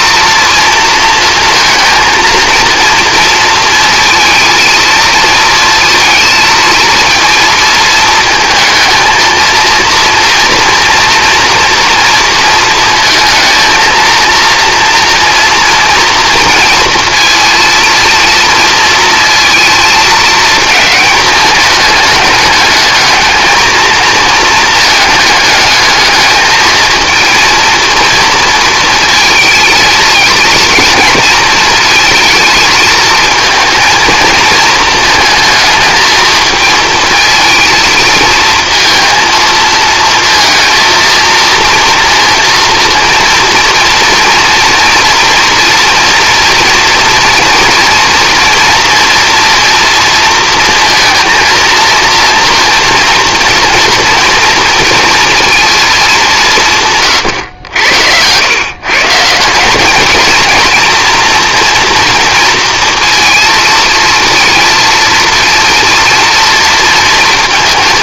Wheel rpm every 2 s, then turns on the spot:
230, 230, 220, 230, 230, 230, 230, 230, 230, 230, 220, 210, 220, 220, 230, 230, 220, 230, 230, 230, 230, 230, 230, 230, 230, 230, 240, 230, 140, 130, 230, 230, 230, 230.
none